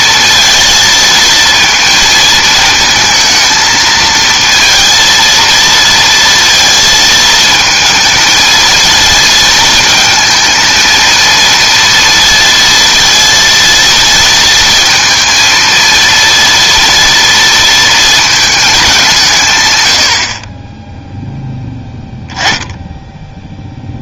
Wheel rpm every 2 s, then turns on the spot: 220, 220, 230, 230, 230, 230, 230, 230, 230, 210, 20, 0.
none